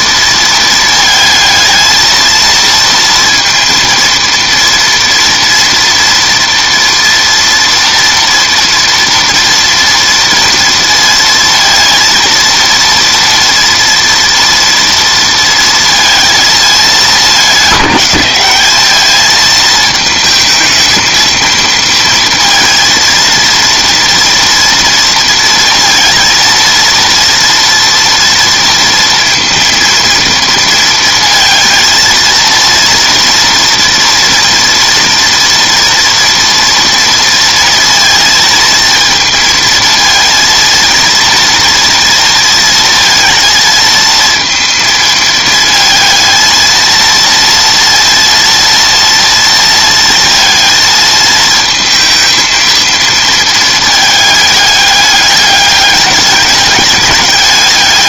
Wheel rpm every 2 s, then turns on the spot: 230, 230, 230, 230, 230, 230, 230, 230, 220, 200, 220, 230, 230, 230, 230, 230, 230, 240, 230, 230, 230, 230, 230, 230, 230, 230, 220, 210, 200.
none